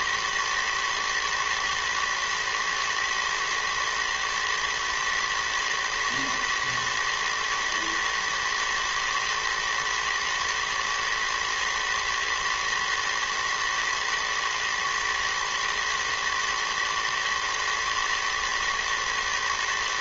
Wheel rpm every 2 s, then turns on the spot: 110, 120, 120, 110, 110, 120, 110, 110, 110, 110.
none